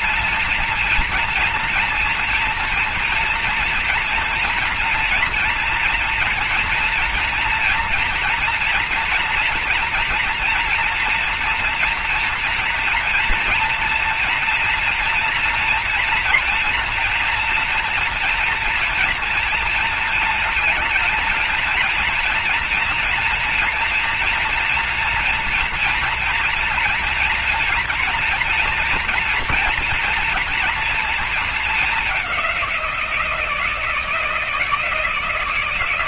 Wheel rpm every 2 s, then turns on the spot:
230, 230, 230, 230, 230, 230, 230, 230, 240, 230, 220, 230, 230, 230, 230, 240, 200, 160.
none